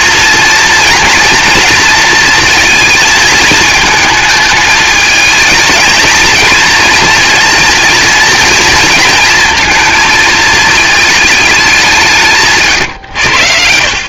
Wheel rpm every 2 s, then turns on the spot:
240, 220, 220, 230, 230, 220, 130.
none